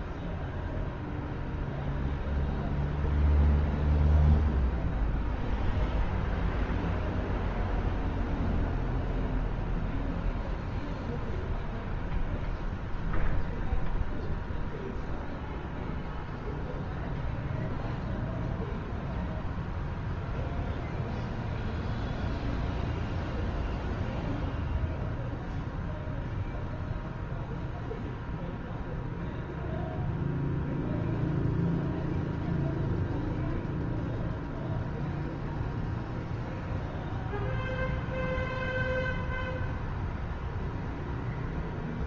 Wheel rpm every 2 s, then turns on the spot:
0, 0, 0, 0, 0, 0, 0, 0, 0, 0, 0, 0, 0, 0, 0, 0, 0, 0, 0, 0, 0.
none